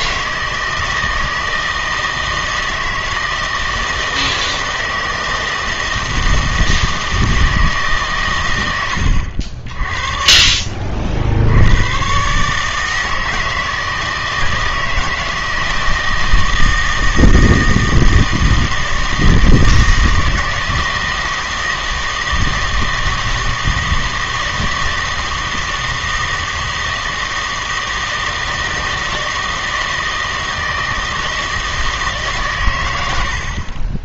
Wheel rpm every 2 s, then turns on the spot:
160, 160, 160, 160, 100, 40, 150, 160, 160, 160, 160, 160, 160, 160, 160, 160, 120.
none